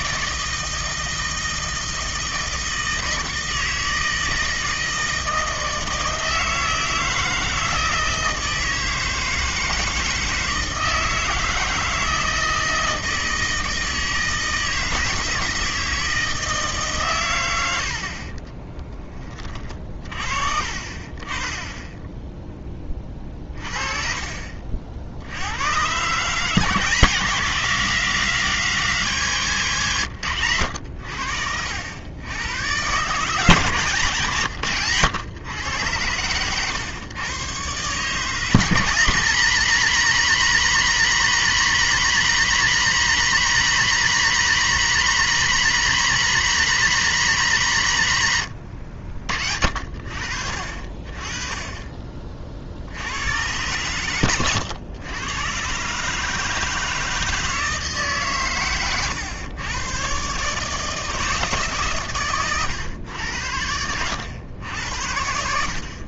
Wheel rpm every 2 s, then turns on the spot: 160, 160, 160, 160, 160, 160, 160, 160, 150, 30, 50, 10, 50, 160, 170, 100, 120, 130, 130, 170, 190, 190, 200, 190, 100, 50, 60, 100, 160, 120, 150, 110, 90.
18-20